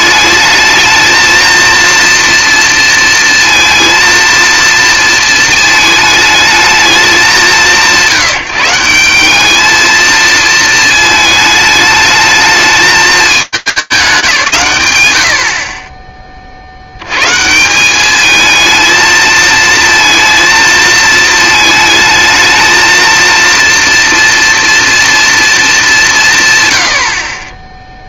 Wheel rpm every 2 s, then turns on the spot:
220, 230, 230, 220, 170, 220, 220, 180, 50, 220, 230, 220, 230, 140.
none